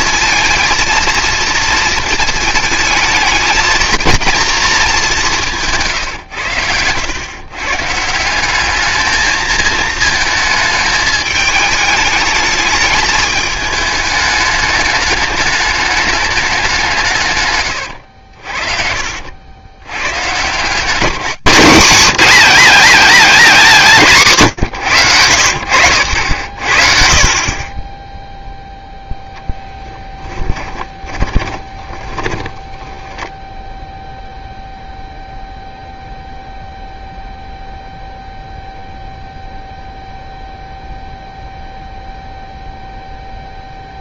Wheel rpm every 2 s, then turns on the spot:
230, 220, 220, 100, 210, 220, 220, 210, 190, 60, 170, 210, 120, 60, 0, 20, 10, 0, 0, 0, 0, 0.
6-8 18-20 30-34